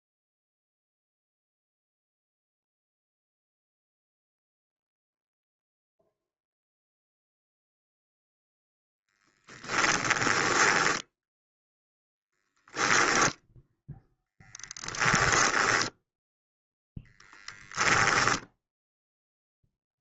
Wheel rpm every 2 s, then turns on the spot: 0, 0, 0, 0, 0, 10, 0, 10, 0, 0.
10-12 14-16